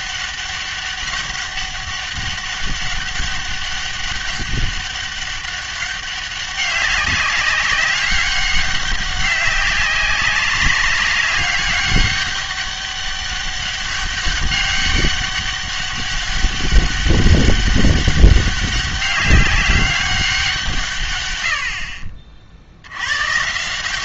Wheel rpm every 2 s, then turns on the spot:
200, 200, 200, 200, 200, 200, 200, 200, 200, 200, 170, 80.
none